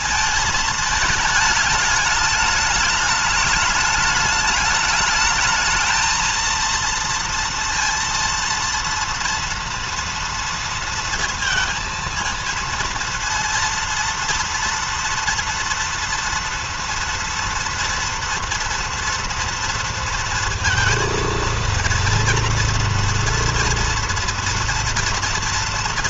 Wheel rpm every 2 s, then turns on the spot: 220, 210, 210, 230, 230, 230, 230, 230, 230, 230, 230, 240, 240.
none